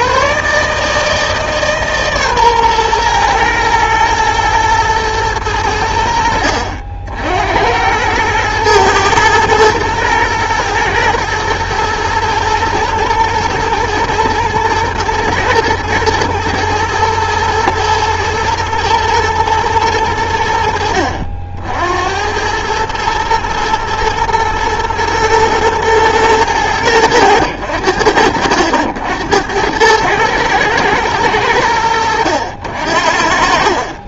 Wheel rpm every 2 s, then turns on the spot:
140, 130, 110, 70, 110, 110, 120, 110, 110, 120, 70, 100, 110, 100, 70, 110, 70.
none